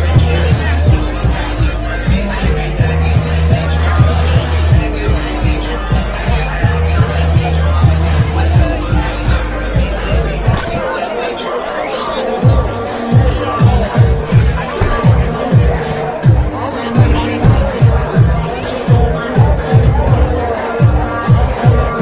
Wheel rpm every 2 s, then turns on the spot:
0, 0, 0, 0, 10, 20, 0, 10, 0, 0, 0.
none